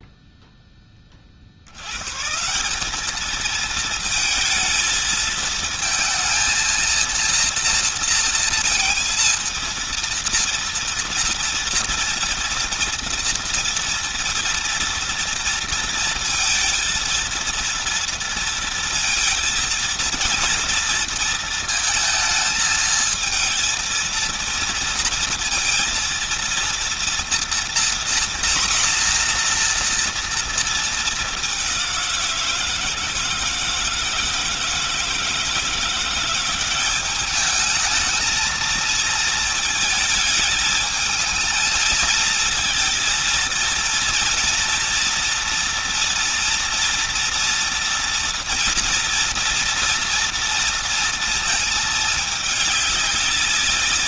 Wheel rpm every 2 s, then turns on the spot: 10, 180, 220, 230, 230, 230, 230, 230, 230, 230, 230, 220, 230, 230, 240, 230, 170, 160, 180, 220, 220, 220, 240, 230, 230, 230, 210.
none